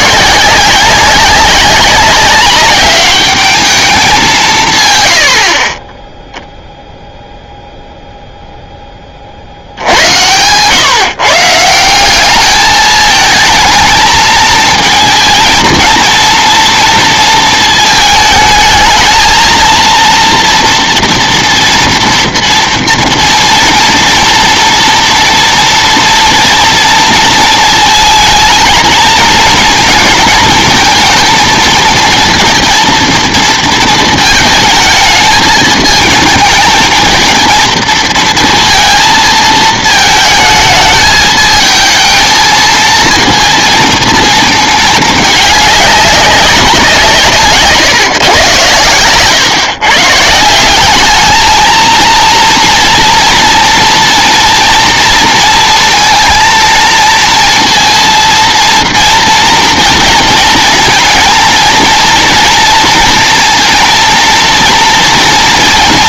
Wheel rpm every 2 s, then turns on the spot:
190, 200, 140, 0, 10, 130, 210, 220, 230, 220, 230, 230, 230, 230, 220, 230, 230, 220, 220, 220, 210, 220, 220, 180, 120, 180, 230, 230, 230, 230, 230, 230, 230.
none